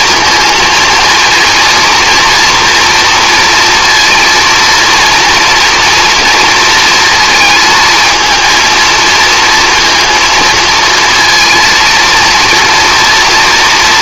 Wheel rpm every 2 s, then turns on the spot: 230, 240, 230, 230, 230, 230, 230.
none